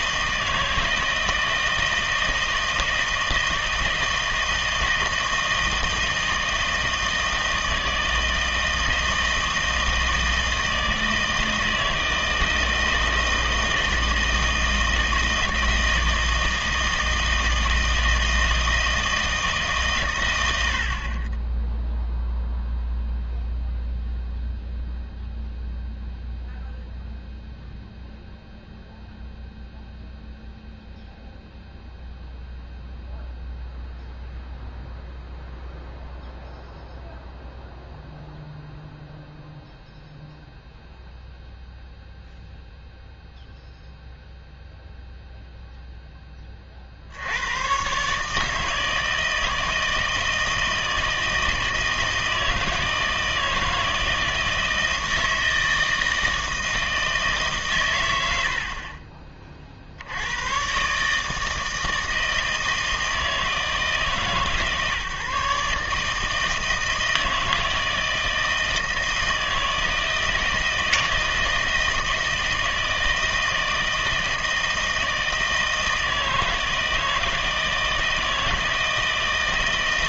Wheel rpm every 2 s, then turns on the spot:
160, 160, 160, 160, 160, 160, 160, 160, 160, 160, 60, 0, 0, 0, 0, 0, 0, 0, 0, 0, 0, 0, 0, 30, 160, 160, 160, 160, 160, 70, 120, 160, 140, 160, 160, 160, 160, 160, 160, 160.
none